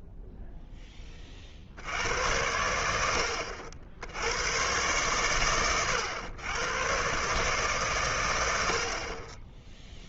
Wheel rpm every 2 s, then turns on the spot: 0, 90, 100, 110, 80.
none